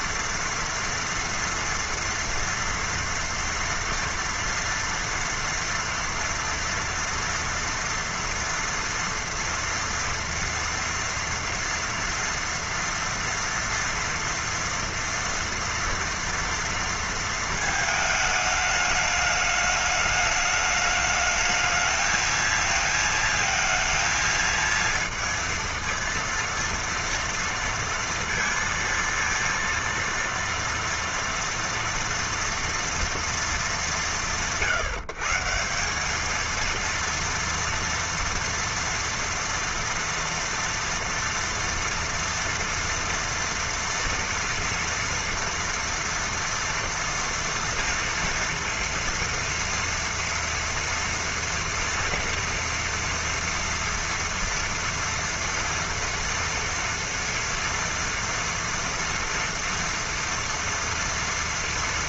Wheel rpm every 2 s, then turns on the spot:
230, 230, 230, 230, 230, 230, 230, 230, 240, 220, 210, 220, 230, 230, 230, 230, 240, 150, 220, 230, 230, 230, 230, 230, 240, 230, 230, 230, 230, 230, 230.
none